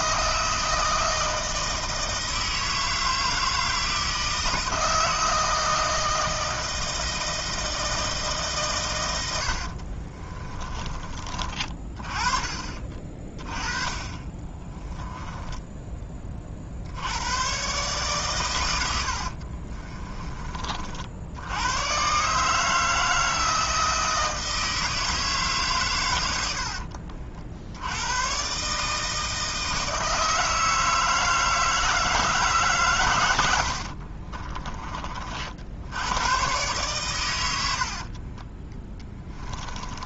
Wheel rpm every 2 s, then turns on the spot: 160, 160, 160, 160, 130, 30, 30, 20, 60, 110, 50, 160, 160, 60, 140, 160, 140, 30, 130, 20.
10-16 18-20 26-28